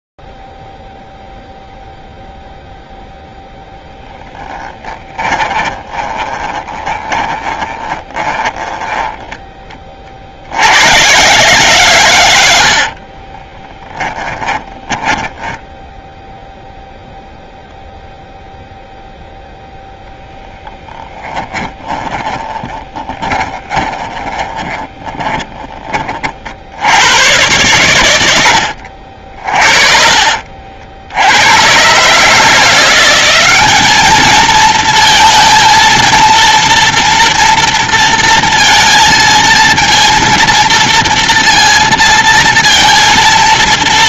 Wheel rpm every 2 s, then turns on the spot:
0, 0, 10, 20, 10, 80, 80, 20, 0, 0, 20, 20, 20, 100, 50, 70, 180, 230, 230, 230, 230, 230.
4-10 20-26